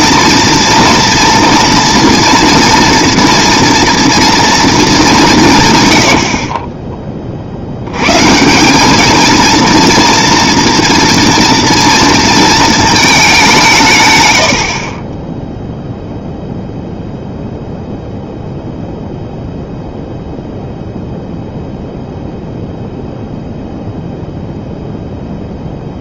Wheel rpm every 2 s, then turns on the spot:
230, 240, 220, 30, 180, 230, 220, 60, 0, 0, 0, 0, 0.
14-16